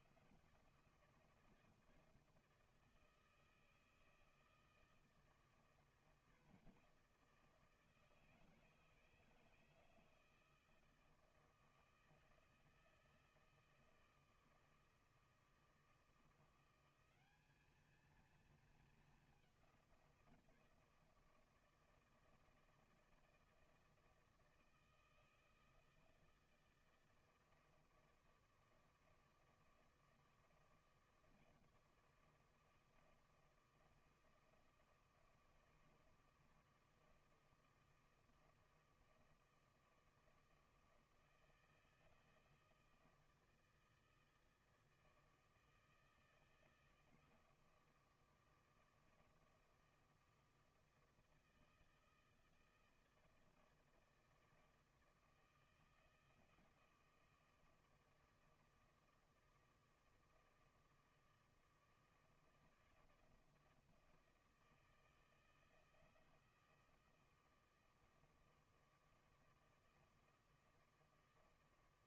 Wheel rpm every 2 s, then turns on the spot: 170, 160, 160, 170, 160, 160, 160, 160, 180, 220, 160, 160, 160, 160, 160, 160, 160, 160, 160, 160, 160, 160, 160, 160, 160, 170, 160, 160, 160, 160, 160, 160, 160, 170, 160, 160.
none